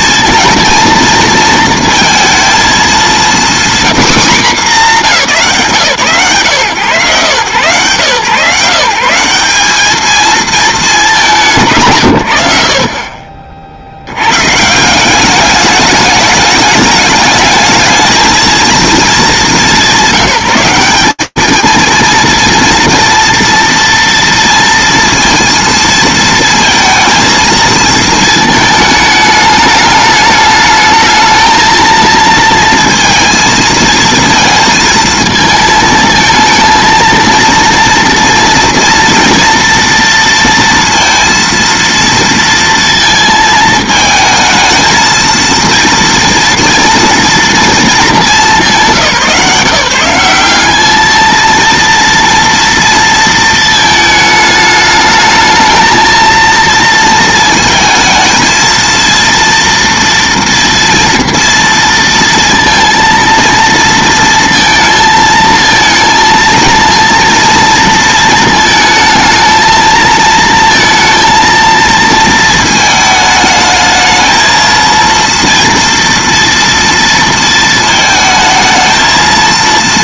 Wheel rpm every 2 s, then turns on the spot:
230, 230, 250, 140, 150, 220, 70, 160, 210, 220, 200, 230, 230, 230, 210, 220, 230, 220, 230, 230, 230, 230, 220, 230, 170, 210, 230, 210, 230, 230, 230, 230, 230, 230, 220, 230, 220, 230, 230, 230.
none